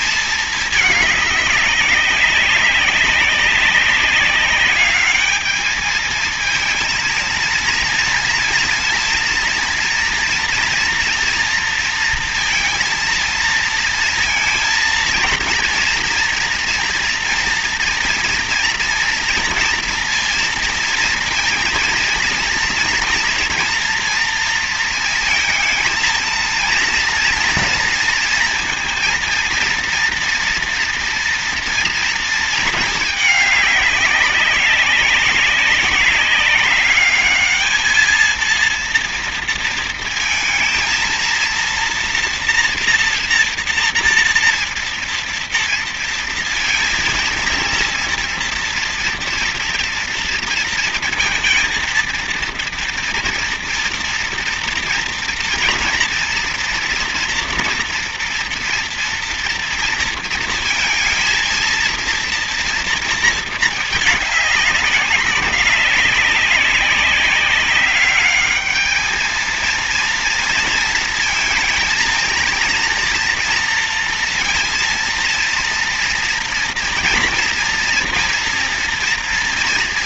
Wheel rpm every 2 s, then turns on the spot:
210, 190, 200, 220, 230, 230, 230, 230, 240, 230, 230, 230, 230, 230, 230, 240, 220, 190, 200, 230, 230, 240, 230, 230, 230, 230, 230, 230, 240, 230, 230, 230, 200, 200, 210, 230, 230, 230, 240, 240.
none